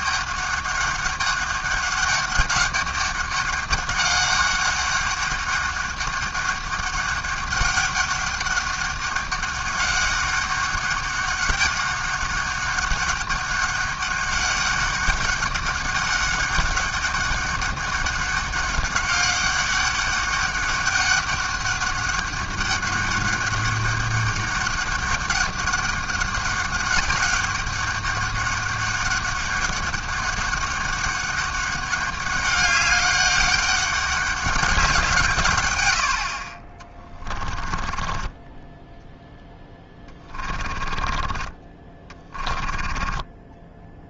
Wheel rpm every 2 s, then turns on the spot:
200, 200, 200, 200, 200, 200, 200, 200, 200, 200, 200, 200, 200, 200, 200, 200, 200, 190, 40, 10, 20, 20.
36-38 40-44